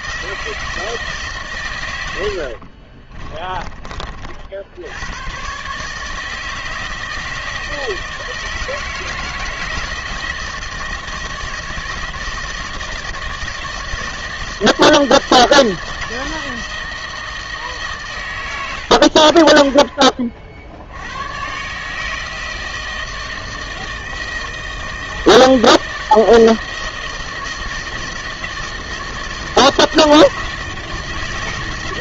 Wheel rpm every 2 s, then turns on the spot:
160, 60, 80, 160, 160, 160, 160, 160, 160, 100, 60, 160, 160, 160, 160, 160.
2-4